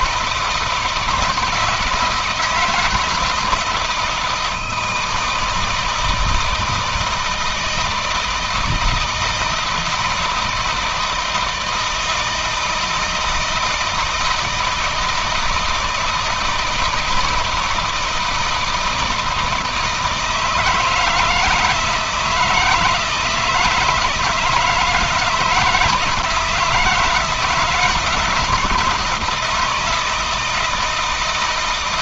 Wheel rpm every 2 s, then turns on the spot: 160, 160, 160, 160, 160, 160, 160, 160, 160, 160, 160, 160, 160, 170, 160, 160.
none